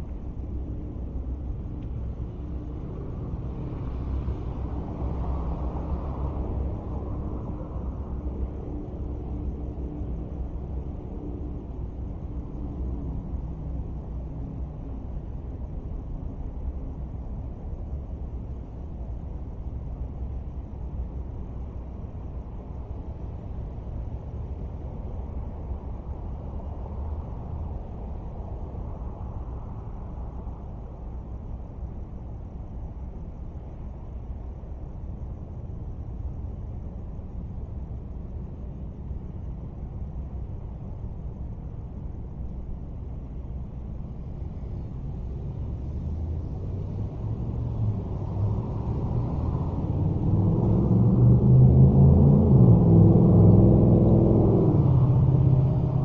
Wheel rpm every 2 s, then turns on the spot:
0, 0, 0, 0, 0, 0, 0, 0, 0, 0, 0, 0, 0, 0, 0, 0, 0, 0, 0, 0, 0, 0, 0, 0, 0, 0, 0, 0.
none